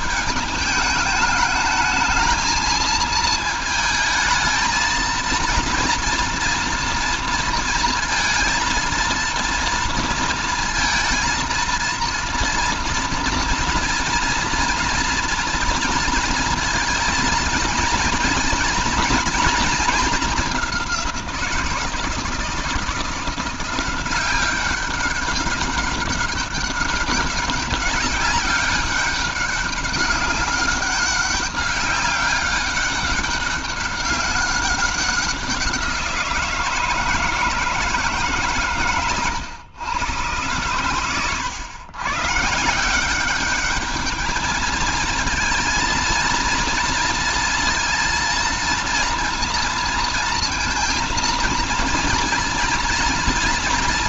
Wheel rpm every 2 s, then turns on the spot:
210, 220, 230, 230, 230, 230, 230, 230, 230, 230, 190, 160, 190, 200, 200, 200, 200, 190, 160, 140, 110, 170, 220, 230, 230, 230, 240.
none